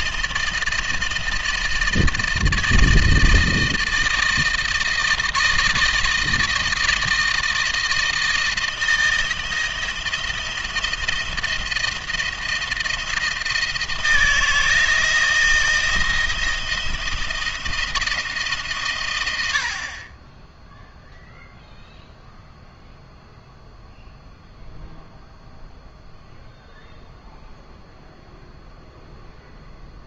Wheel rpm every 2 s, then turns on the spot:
160, 160, 160, 160, 160, 170, 160, 160, 170, 140, 10, 0, 0, 0, 0.
none